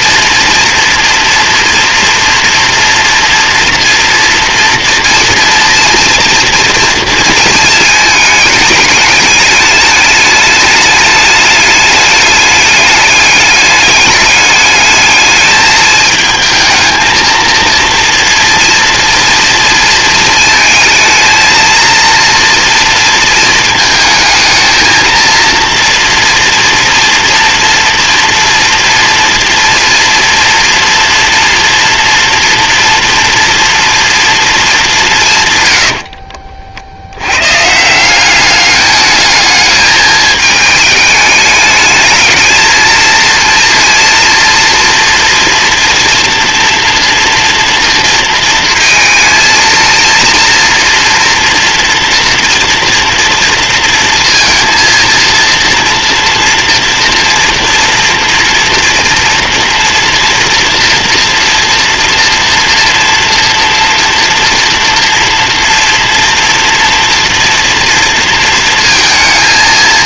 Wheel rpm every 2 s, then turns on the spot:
230, 230, 230, 230, 210, 210, 210, 210, 220, 230, 230, 230, 220, 230, 230, 230, 230, 210, 70, 210, 210, 220, 230, 230, 230, 230, 230, 230, 230, 230, 230, 230, 230, 230, 230.
none